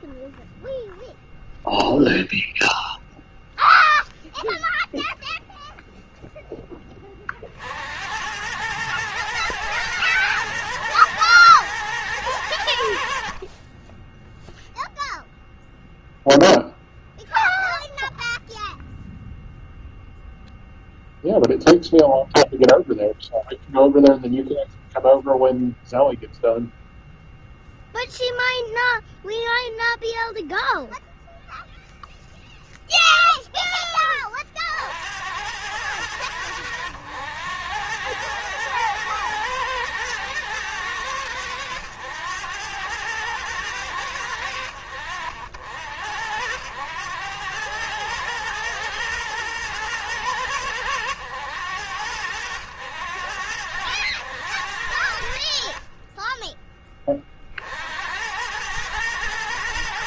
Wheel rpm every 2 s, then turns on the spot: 0, 0, 0, 20, 100, 110, 90, 0, 0, 0, 0, 0, 0, 0, 0, 0, 0, 50, 100, 110, 110, 100, 80, 90, 120, 100, 90, 80, 20, 110.
none